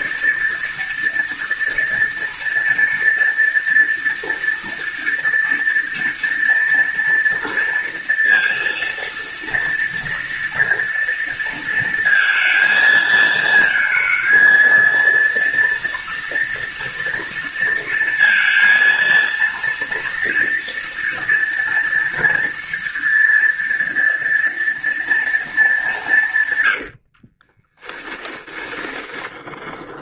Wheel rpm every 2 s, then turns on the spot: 230, 230, 230, 230, 230, 230, 220, 230, 230, 230, 230, 230, 230, 40, 20.
26-30